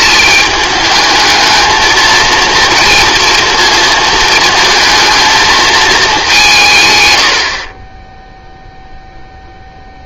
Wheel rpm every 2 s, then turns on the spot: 210, 230, 220, 150, 0.
none